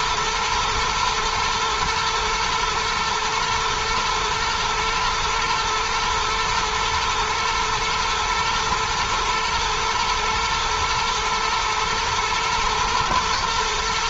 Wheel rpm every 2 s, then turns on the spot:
110, 110, 120, 110, 110, 120, 110.
none